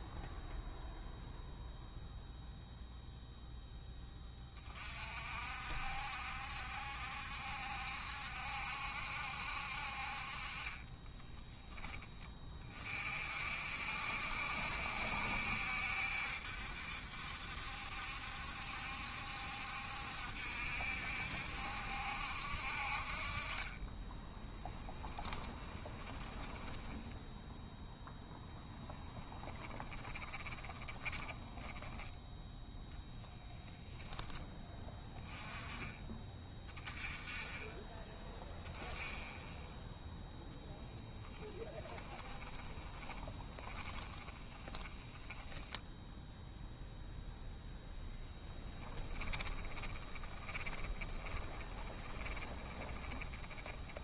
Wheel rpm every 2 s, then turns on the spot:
0, 0, 30, 70, 70, 40, 40, 70, 70, 70, 70, 60, 20, 20, 10, 20, 0, 10, 20, 10, 0, 10, 10, 0, 10, 20, 10.
24-32 42-46 48-54